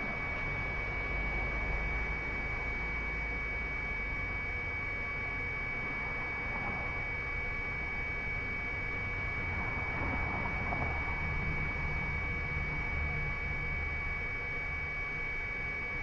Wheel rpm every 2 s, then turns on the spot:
0, 0, 0, 0, 0, 0, 0, 0.
none